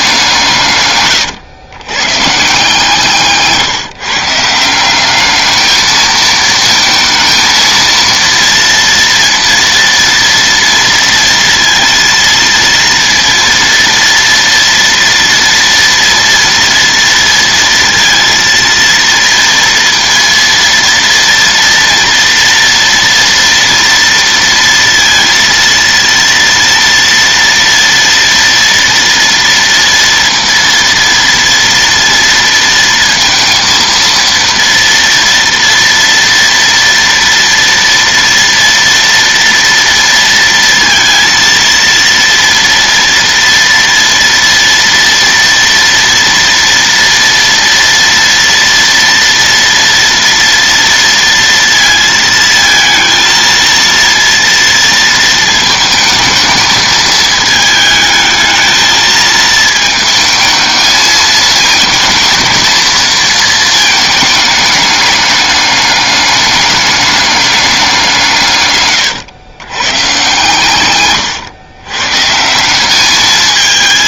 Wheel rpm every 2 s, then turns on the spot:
160, 150, 170, 220, 230, 230, 230, 230, 230, 230, 230, 240, 230, 230, 230, 230, 230, 230, 230, 230, 230, 230, 230, 230, 230, 230, 230, 230, 220, 220, 220, 230, 210, 200, 150, 130, 180.
none